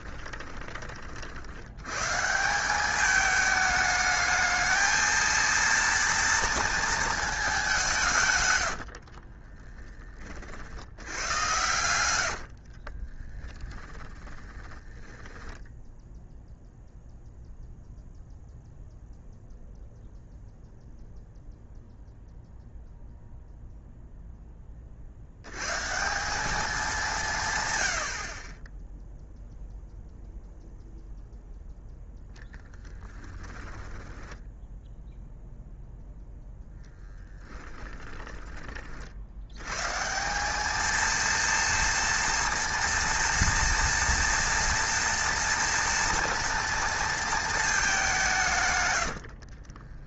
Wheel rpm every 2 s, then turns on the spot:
30, 190, 220, 230, 80, 70, 50, 20, 0, 0, 0, 0, 30, 190, 10, 0, 10, 0, 0, 40, 220, 230, 230, 230, 110.
8-10 12-16 32-34 48-50